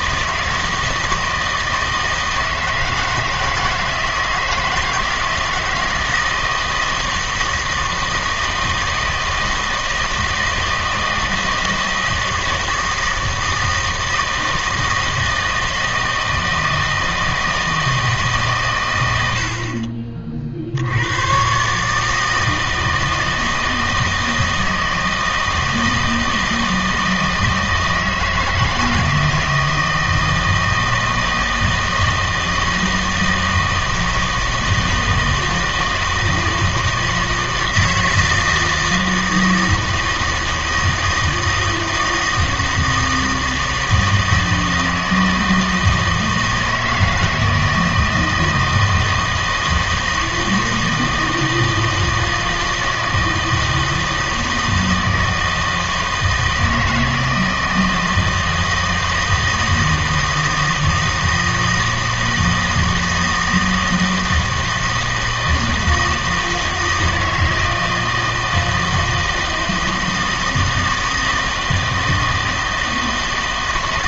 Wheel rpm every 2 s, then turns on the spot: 160, 160, 170, 160, 160, 160, 160, 160, 160, 140, 60, 160, 160, 160, 160, 160, 160, 160, 160, 160, 160, 160, 160, 160, 160, 160, 160, 160, 160, 160, 160, 160, 160, 160, 160, 160, 160.
none